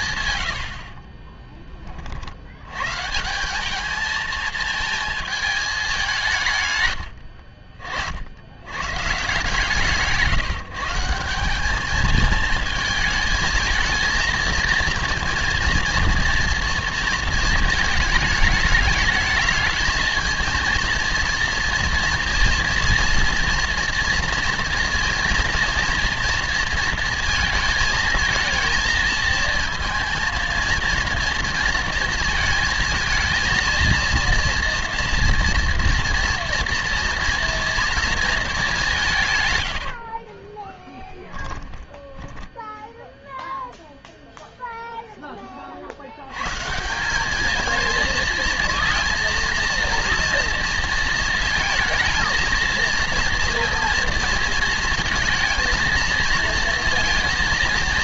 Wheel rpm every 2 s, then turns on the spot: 80, 110, 220, 140, 90, 150, 220, 230, 230, 220, 230, 230, 230, 230, 230, 230, 230, 230, 230, 210, 20, 0, 0, 140, 220, 230, 230, 220, 230.
0-2 40-42